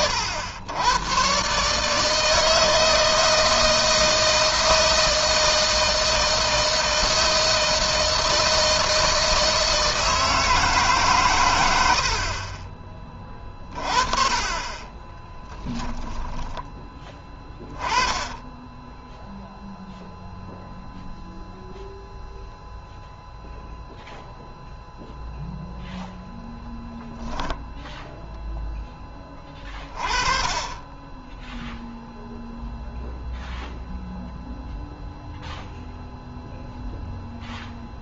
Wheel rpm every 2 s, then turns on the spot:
110, 160, 160, 160, 160, 150, 20, 20, 20, 10, 0, 0, 0, 0, 10, 10, 0, 0, 0.
14-16